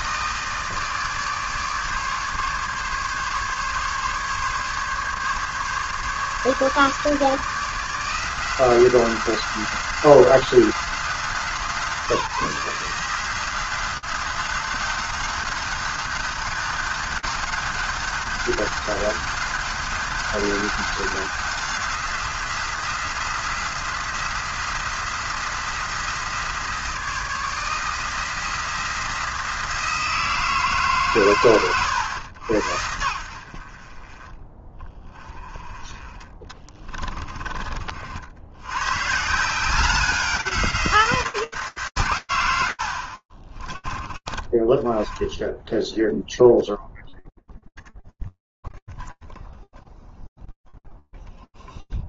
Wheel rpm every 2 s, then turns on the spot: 150, 140, 140, 150, 180, 180, 170, 190, 190, 200, 180, 180, 170, 160, 170, 120, 60, 20, 40, 180, 170, 50, 20, 0, 0, 0.
none